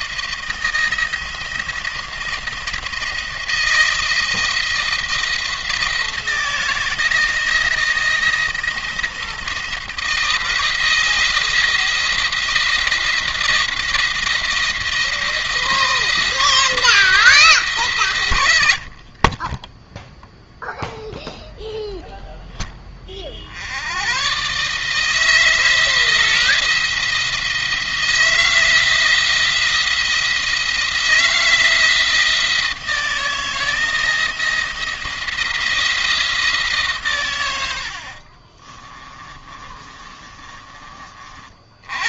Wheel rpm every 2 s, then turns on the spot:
170, 170, 170, 170, 170, 160, 170, 170, 170, 80, 0, 10, 150, 170, 170, 170, 160, 170, 140, 30, 30.
38-42